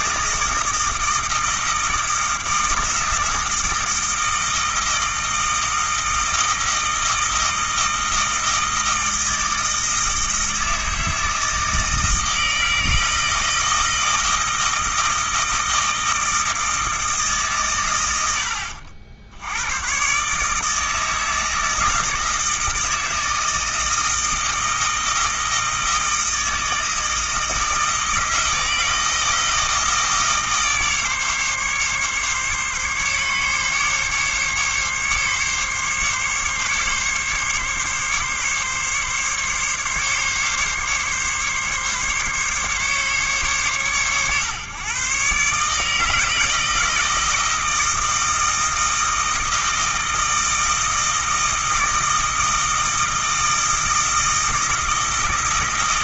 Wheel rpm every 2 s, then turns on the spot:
160, 160, 160, 160, 160, 160, 160, 160, 160, 80, 160, 160, 160, 160, 160, 150, 140, 140, 140, 140, 140, 140, 130, 160, 160, 160, 160, 160.
none